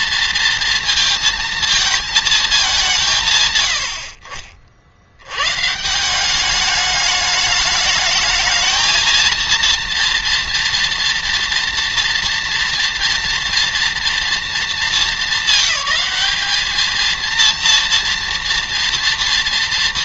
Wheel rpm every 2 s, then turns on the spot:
230, 190, 60, 200, 220, 230, 240, 220, 220, 230.
none